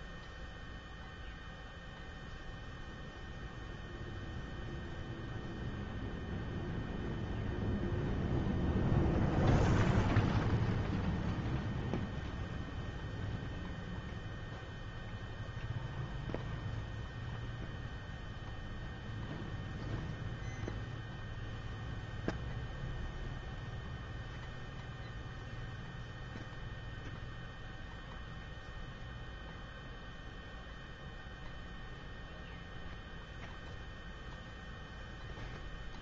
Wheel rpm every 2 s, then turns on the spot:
0, 0, 0, 0, 0, 0, 0, 0, 0, 0, 0, 0, 0, 0, 0, 0, 0, 0.
none